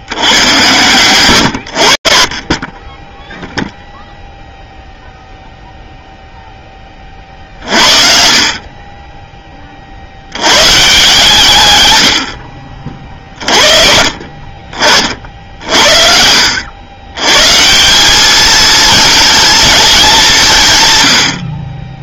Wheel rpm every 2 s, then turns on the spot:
110, 40, 0, 10, 50, 140, 50, 50, 100, 230, 110.
none